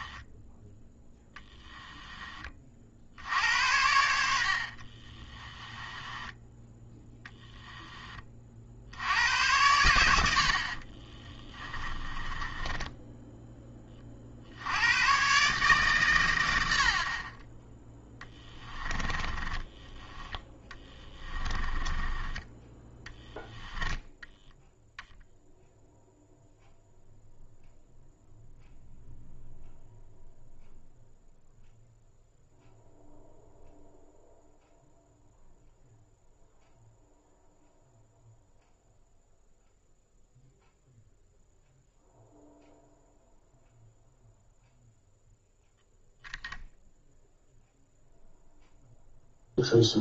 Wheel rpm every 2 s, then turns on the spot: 10, 60, 40, 10, 80, 40, 10, 100, 40, 20, 20, 10, 0, 0, 0, 0, 0, 0, 0, 0, 0, 0, 0, 10, 0.
4-6 10-14 18-22